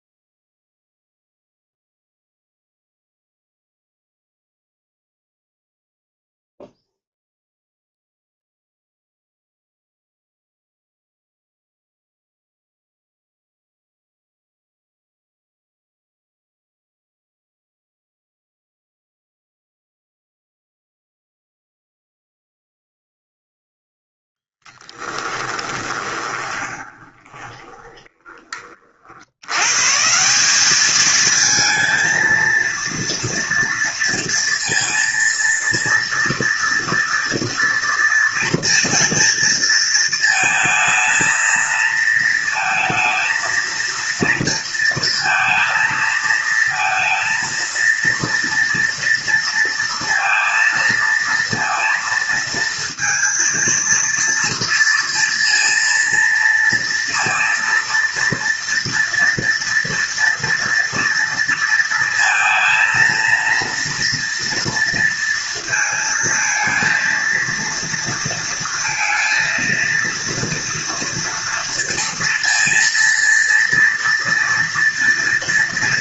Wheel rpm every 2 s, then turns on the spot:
0, 0, 0, 0, 0, 0, 0, 0, 0, 0, 0, 0, 10, 20, 90, 220, 230, 230, 230, 230, 220, 230, 230, 230, 230, 230, 230, 230, 230, 230, 230, 230, 230, 230, 230, 230, 230, 230.
24-28